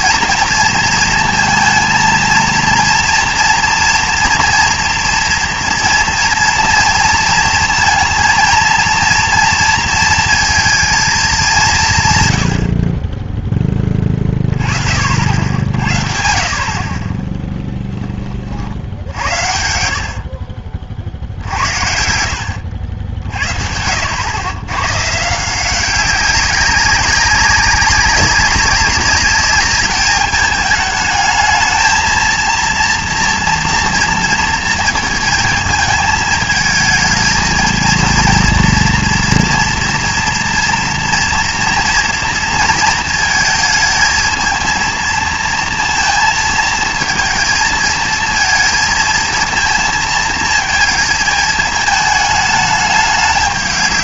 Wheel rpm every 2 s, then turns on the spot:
230, 230, 230, 230, 230, 230, 70, 40, 40, 50, 50, 70, 110, 190, 200, 210, 230, 230, 220, 230, 230, 230, 230, 230, 230, 230, 210.
none